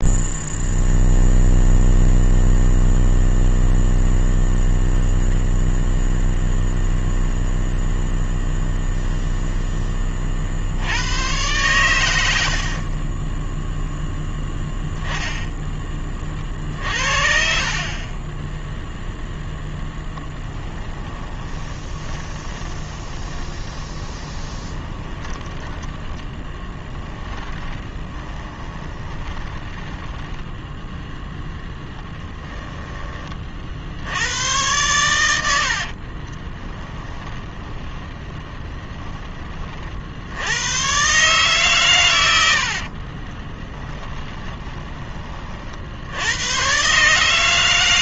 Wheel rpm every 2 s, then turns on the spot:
0, 0, 0, 0, 0, 80, 40, 0, 50, 0, 10, 30, 20, 10, 20, 10, 20, 110, 10, 20, 110, 50, 20, 120.
12-14 20-30 36-40 42-44